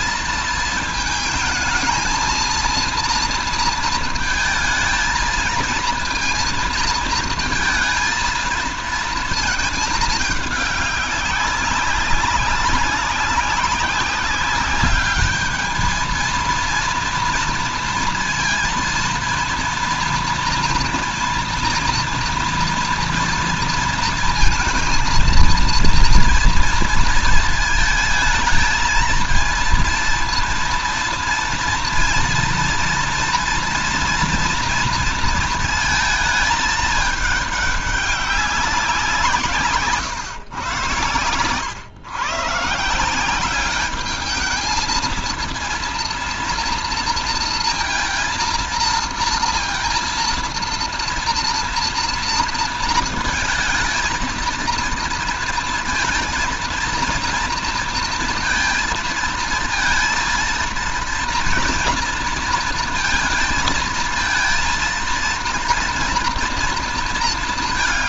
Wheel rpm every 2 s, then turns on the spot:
220, 230, 220, 230, 230, 210, 200, 200, 230, 230, 230, 230, 230, 230, 220, 230, 230, 230, 210, 190, 120, 150, 220, 230, 230, 230, 230, 230, 220, 220, 230, 230, 230, 230.
none